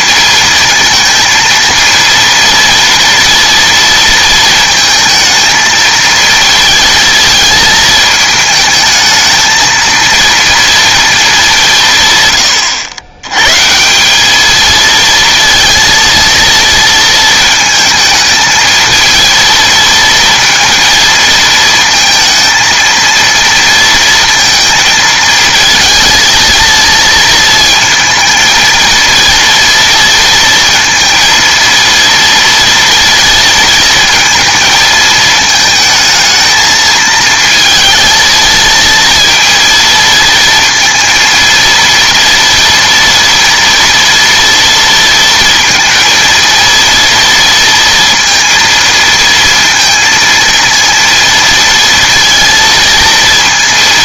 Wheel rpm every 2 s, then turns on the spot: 230, 230, 230, 230, 220, 230, 100, 220, 230, 220, 220, 230, 230, 230, 230, 230, 230, 230, 220, 230, 230, 230, 230, 230, 230, 230, 230.
none